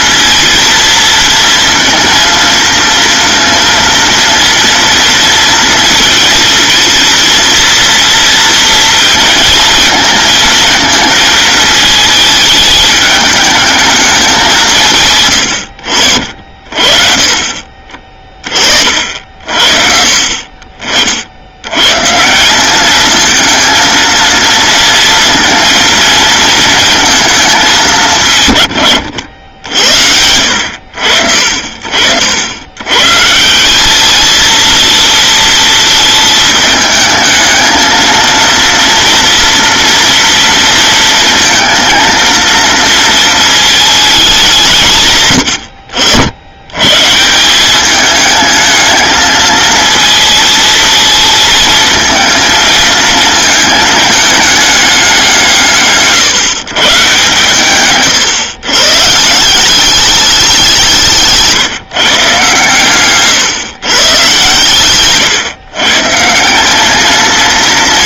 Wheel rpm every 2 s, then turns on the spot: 230, 230, 230, 230, 230, 220, 210, 170, 50, 40, 40, 190, 230, 220, 130, 80, 90, 220, 220, 230, 230, 230, 170, 120, 220, 220, 230, 210, 140, 120, 190, 140, 120, 190.
none